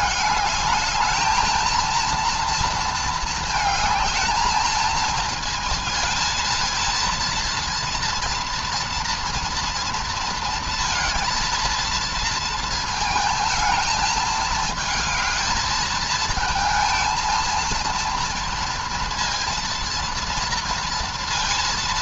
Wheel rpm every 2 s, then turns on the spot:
220, 230, 220, 230, 240, 230, 230, 220, 220, 230, 230.
none